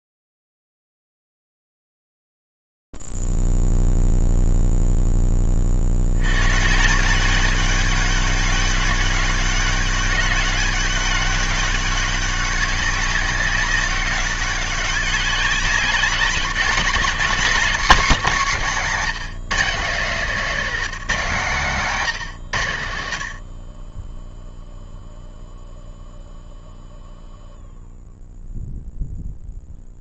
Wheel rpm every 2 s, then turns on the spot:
10, 10, 0, 50, 200, 200, 200, 200, 190, 210, 180, 150, 10, 0, 0.
none